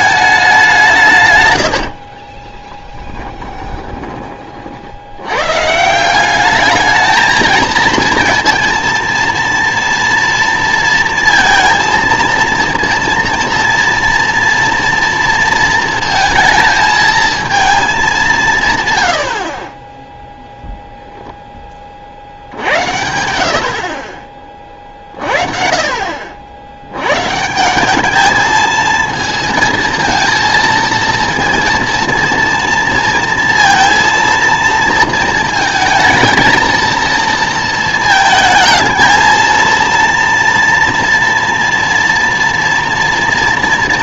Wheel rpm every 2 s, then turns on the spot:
170, 10, 60, 210, 230, 230, 230, 230, 220, 150, 0, 80, 50, 90, 220, 230, 230, 230, 230, 220, 230, 230.
2-4